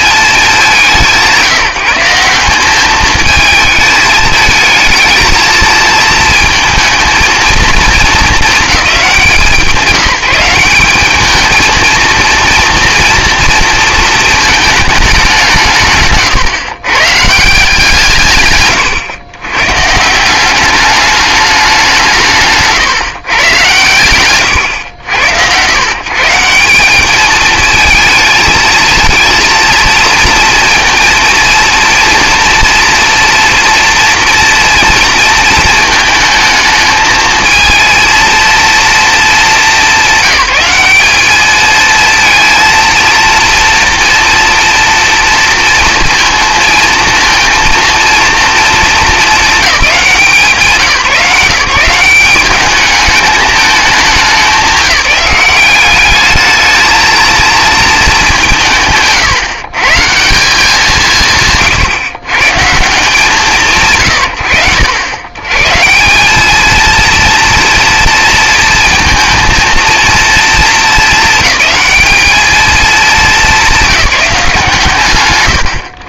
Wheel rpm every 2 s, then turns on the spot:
190, 190, 220, 230, 200, 190, 230, 220, 130, 130, 190, 160, 100, 170, 220, 230, 230, 230, 220, 230, 200, 220, 230, 230, 230, 170, 200, 180, 210, 180, 180, 120, 70, 200, 230, 230, 210, 140.
18-20